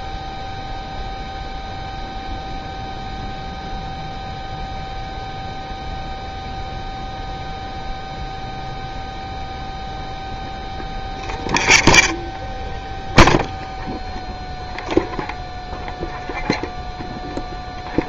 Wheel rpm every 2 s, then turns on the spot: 0, 0, 0, 0, 0, 0, 0, 0, 0.
none